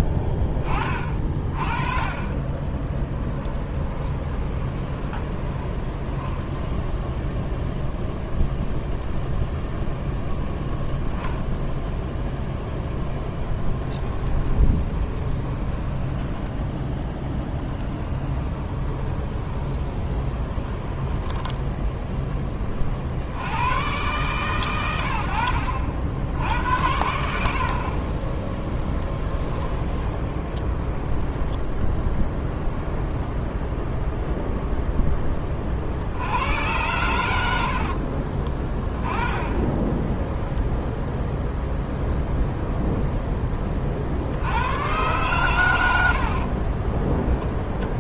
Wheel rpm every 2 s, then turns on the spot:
30, 20, 20, 10, 0, 0, 0, 20, 10, 20, 20, 20, 120, 80, 10, 20, 10, 0, 100, 20, 10, 0, 100, 40.
4-8 14-16 18-22 28-34 38-40 46-48